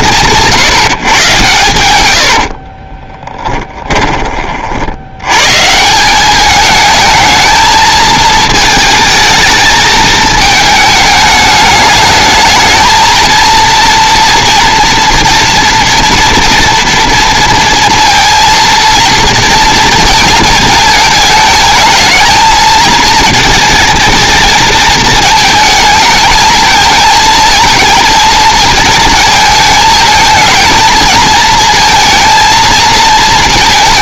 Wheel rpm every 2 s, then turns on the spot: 150, 40, 60, 210, 220, 220, 220, 230, 230, 230, 220, 220, 220, 220, 230, 220, 230.
2-4